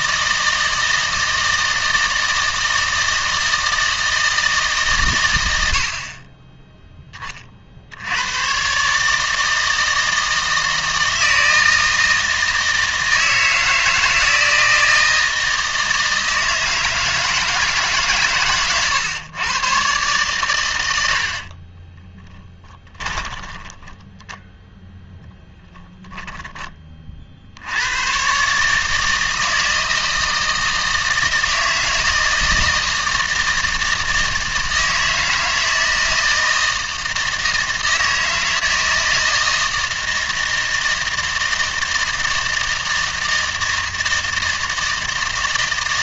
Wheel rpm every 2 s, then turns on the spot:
160, 160, 140, 10, 130, 160, 160, 160, 160, 130, 100, 10, 0, 20, 150, 160, 160, 160, 160, 160, 160, 160, 160.
22-24